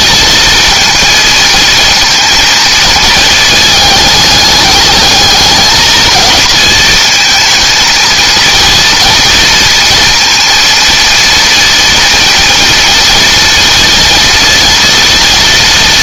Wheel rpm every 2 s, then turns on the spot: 230, 220, 210, 230, 230, 230, 230, 230.
none